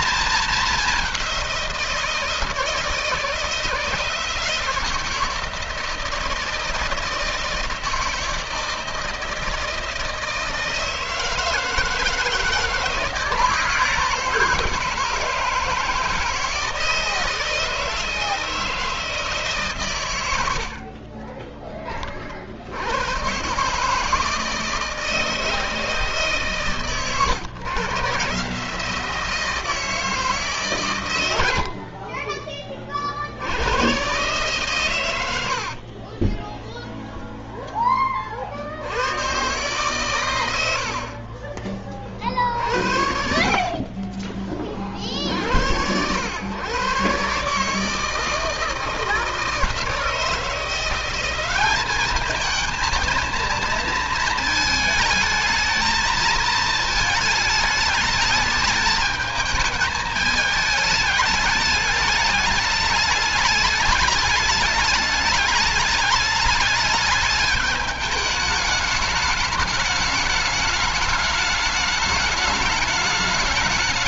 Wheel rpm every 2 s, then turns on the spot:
210, 160, 170, 160, 160, 160, 160, 160, 160, 160, 60, 90, 160, 140, 150, 130, 40, 120, 20, 80, 80, 50, 40, 120, 160, 180, 230, 220, 220, 210, 210, 210, 210, 210, 210, 210, 210.
36-38